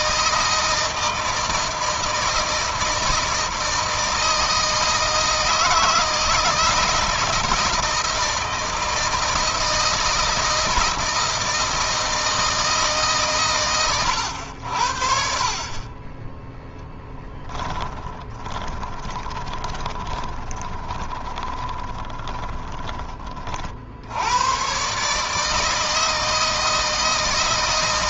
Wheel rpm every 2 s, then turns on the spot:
160, 160, 160, 160, 160, 160, 150, 60, 10, 20, 20, 30, 130, 160.
16-22